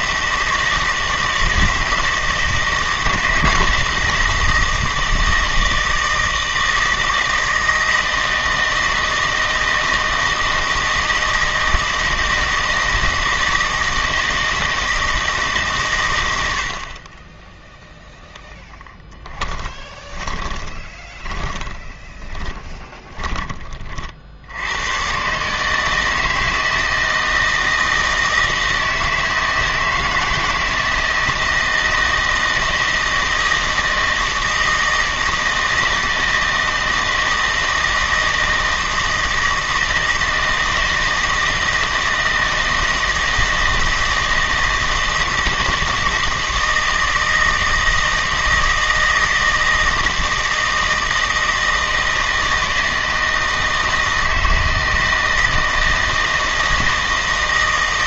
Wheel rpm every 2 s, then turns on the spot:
160, 160, 160, 160, 160, 160, 160, 160, 80, 10, 20, 10, 90, 160, 160, 170, 160, 160, 160, 160, 160, 160, 160, 160, 160, 160, 160, 160, 160.
18-24